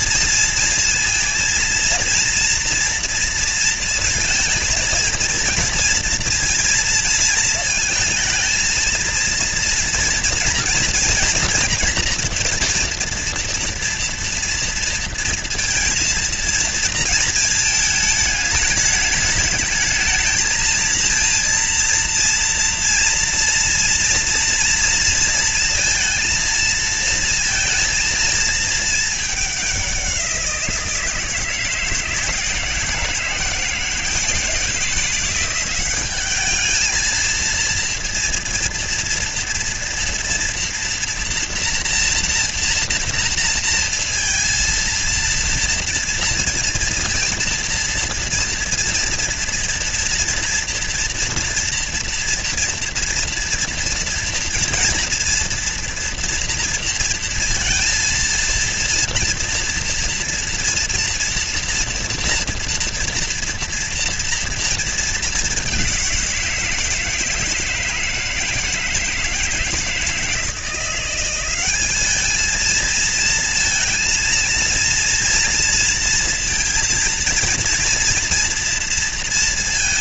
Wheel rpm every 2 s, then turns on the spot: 230, 240, 230, 230, 220, 230, 230, 230, 230, 220, 230, 230, 230, 230, 230, 170, 160, 170, 210, 230, 230, 240, 230, 230, 230, 230, 230, 230, 230, 230, 230, 230, 230, 170, 160, 170, 220, 230, 230, 230.
none